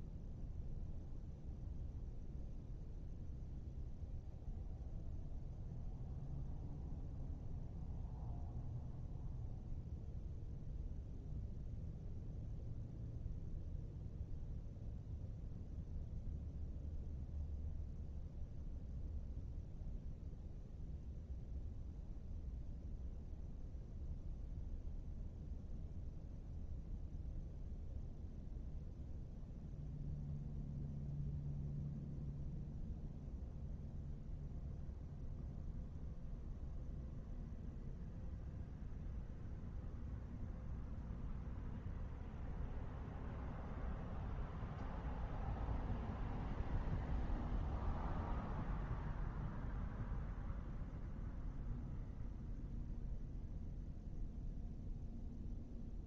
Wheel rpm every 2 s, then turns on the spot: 0, 0, 0, 0, 0, 0, 0, 0, 0, 0, 0, 0, 0, 0, 0, 0, 0, 0, 0, 0, 0, 0, 0, 0, 0, 0, 0, 0.
none